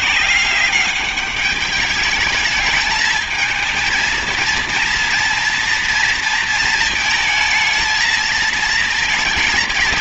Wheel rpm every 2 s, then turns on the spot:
190, 220, 230, 230, 220.
none